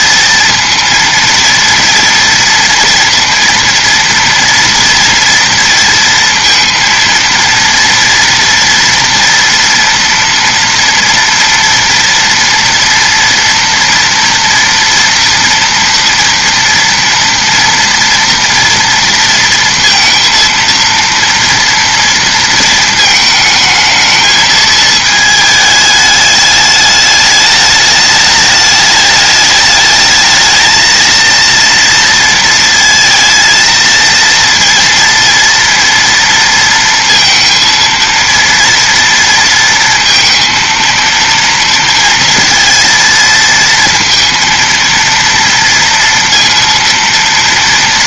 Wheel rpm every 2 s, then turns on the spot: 230, 230, 230, 230, 230, 230, 230, 230, 230, 230, 230, 220, 220, 210, 210, 230, 230, 230, 230, 230, 230, 230, 230, 230.
none